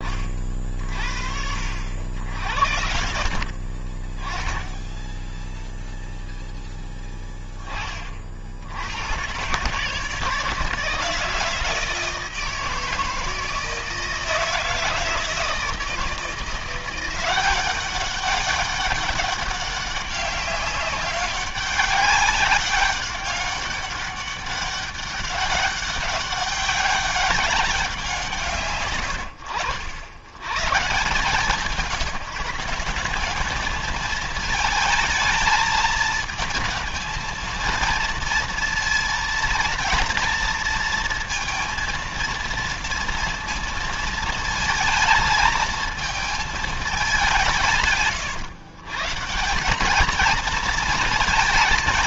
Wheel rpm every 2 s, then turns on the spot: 30, 70, 20, 0, 80, 160, 160, 160, 170, 200, 190, 200, 200, 190, 150, 120, 180, 230, 220, 230, 230, 230, 220, 220, 130, 220.
none